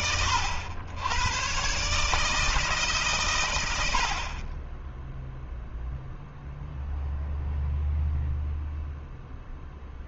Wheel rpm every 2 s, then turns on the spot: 90, 150, 10, 0, 0.
none